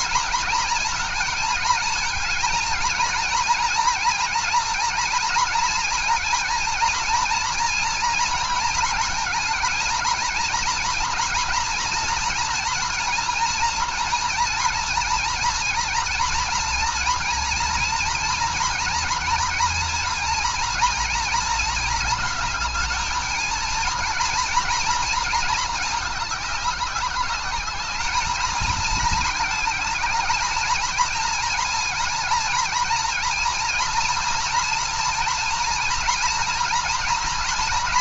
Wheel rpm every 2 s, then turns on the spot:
230, 230, 230, 230, 220, 240, 230, 230, 230, 230, 230, 220, 230, 200, 220, 230, 240, 230, 240.
none